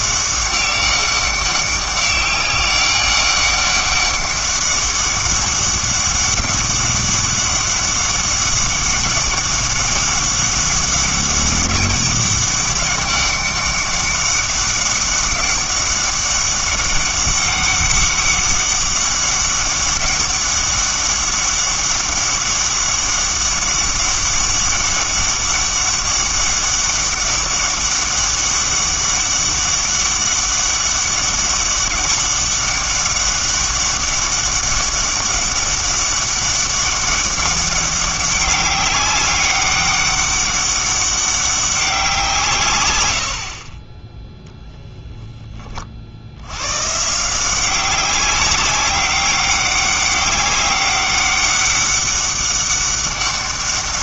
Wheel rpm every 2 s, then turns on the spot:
200, 200, 200, 200, 200, 200, 200, 200, 200, 200, 200, 200, 200, 200, 200, 200, 200, 200, 200, 200, 200, 130, 0, 100, 190, 200, 200.
none